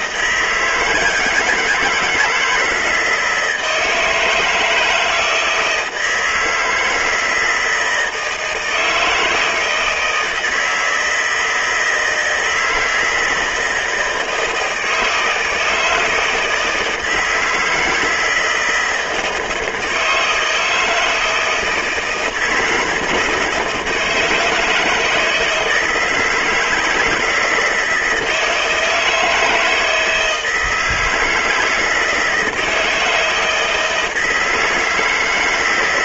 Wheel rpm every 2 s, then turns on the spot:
170, 160, 160, 160, 160, 170, 160, 160, 160, 160, 160, 160, 160, 160, 160, 160, 160, 160.
none